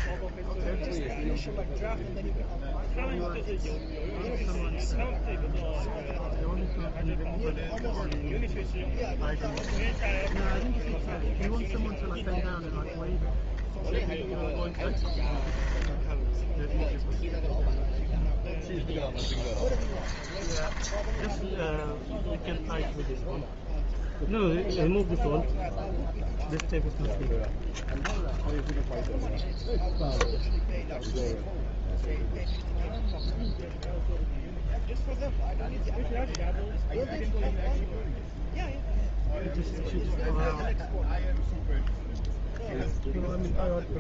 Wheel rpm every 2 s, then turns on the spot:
0, 0, 0, 0, 10, 0, 10, 10, 0, 20, 0, 0, 0, 0, 0, 0, 0, 0, 0, 0, 0, 0.
8-10 14-16 18-20